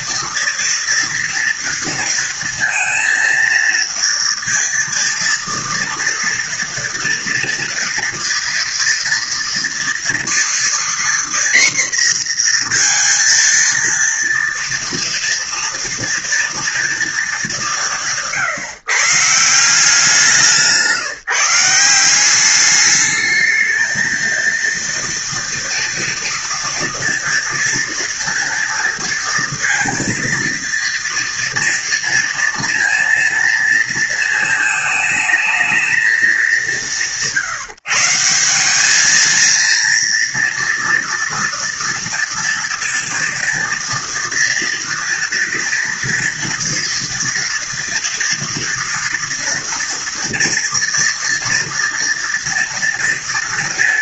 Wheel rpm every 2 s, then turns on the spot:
230, 230, 230, 230, 230, 240, 230, 230, 230, 150, 160, 210, 230, 230, 230, 230, 230, 220, 150, 200, 230, 230, 230, 230, 230, 230, 230.
none